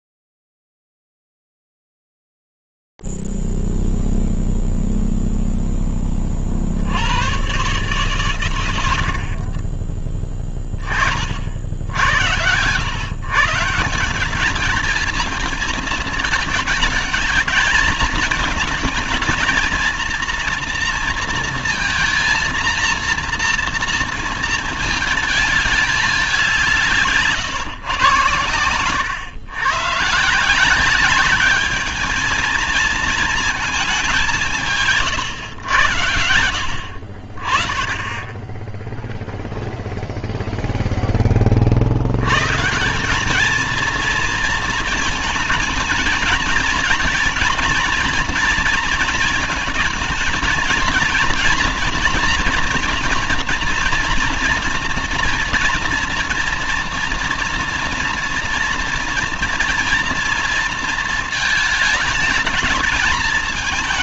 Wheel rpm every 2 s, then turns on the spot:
0, 0, 0, 30, 140, 20, 90, 190, 220, 220, 230, 230, 230, 190, 110, 160, 220, 170, 70, 10, 0, 160, 220, 230, 230, 230, 230, 230, 240, 230, 230, 220.
none